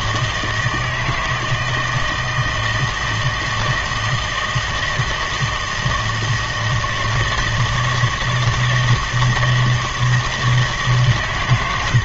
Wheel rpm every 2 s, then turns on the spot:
160, 160, 160, 160, 160, 150.
none